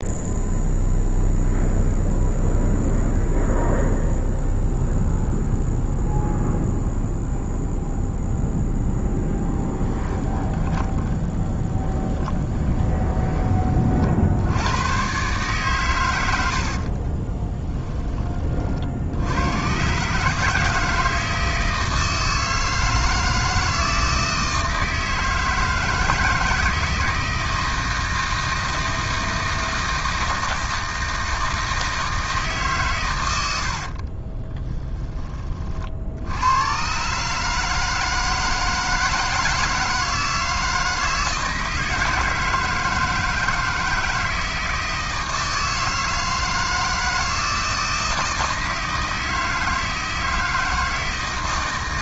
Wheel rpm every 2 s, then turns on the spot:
0, 0, 0, 0, 0, 20, 20, 120, 40, 70, 160, 160, 160, 160, 160, 160, 130, 10, 120, 160, 160, 160, 160, 160, 160, 160.
10-14 16-18